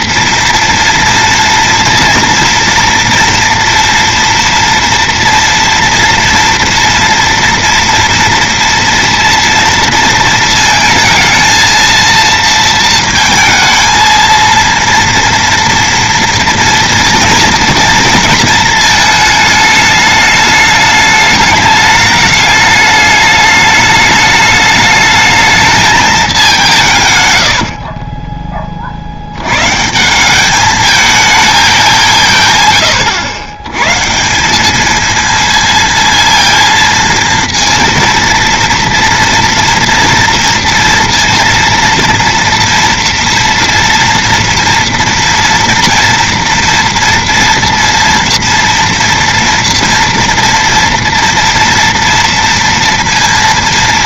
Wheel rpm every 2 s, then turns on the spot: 230, 230, 230, 230, 240, 220, 230, 230, 240, 220, 210, 210, 210, 170, 30, 210, 140, 200, 230, 230, 230, 230, 230, 230, 230, 230, 230.
none